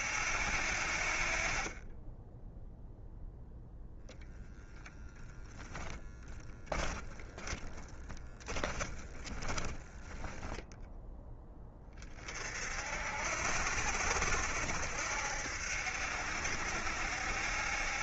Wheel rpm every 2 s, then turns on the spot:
60, 0, 0, 20, 10, 10, 60, 70, 70.
6-10